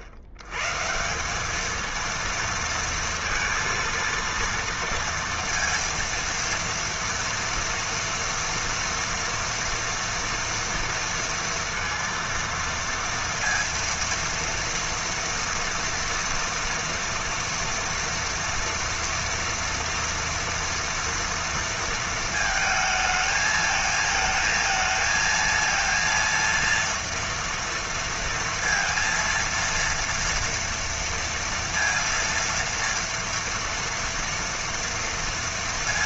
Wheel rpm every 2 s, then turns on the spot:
110, 230, 230, 230, 240, 230, 230, 230, 230, 230, 230, 220, 220, 230, 230, 230, 230, 230.
none